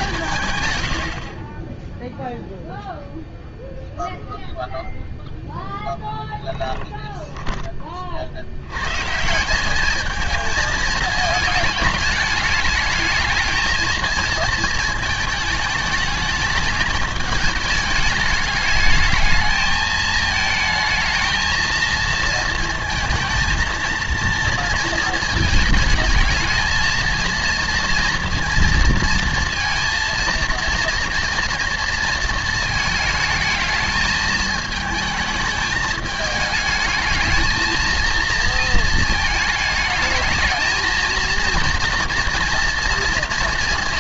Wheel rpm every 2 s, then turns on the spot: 140, 0, 0, 10, 90, 220, 220, 220, 210, 210, 220, 230, 230, 220, 230, 230, 230, 220, 220, 230, 220, 240.
6-8